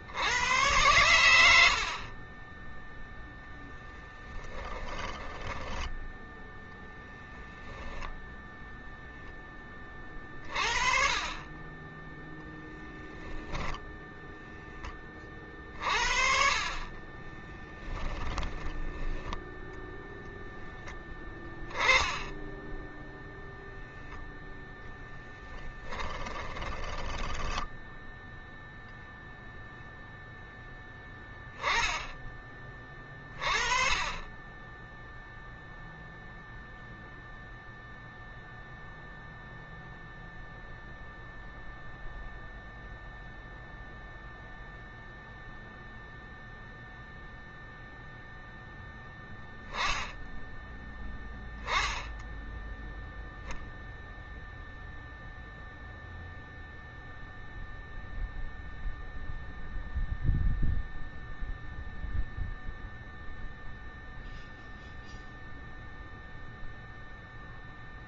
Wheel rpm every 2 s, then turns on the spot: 100, 10, 10, 0, 0, 40, 0, 20, 30, 10, 10, 0, 0, 20, 0, 10, 20, 10, 0, 0, 0, 0, 0, 0, 0, 0, 0, 0, 0, 0, 0, 0, 0, 0.
2-6 16-20 26-28